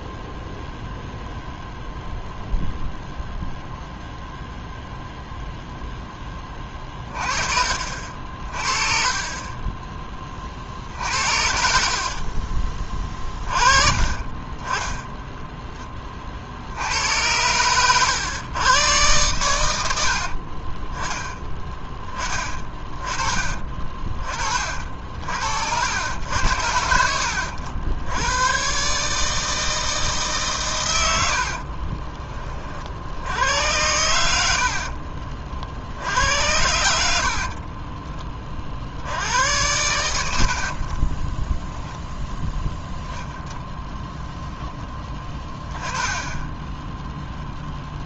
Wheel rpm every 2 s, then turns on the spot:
0, 0, 0, 30, 30, 50, 20, 20, 80, 110, 20, 20, 50, 70, 140, 100, 50, 60, 80, 60, 40, 0, 10, 10.
30-32 34-36 46-48